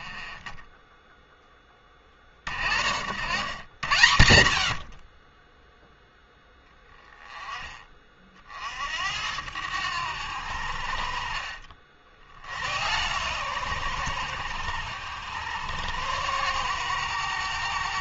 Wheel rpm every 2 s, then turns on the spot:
10, 60, 50, 10, 60, 70, 90, 90, 110.
none